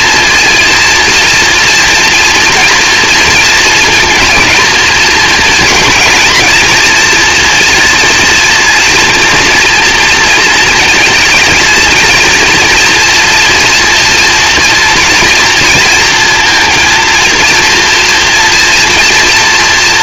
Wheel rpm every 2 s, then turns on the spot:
240, 230, 230, 230, 240, 230, 230, 230, 230, 230.
none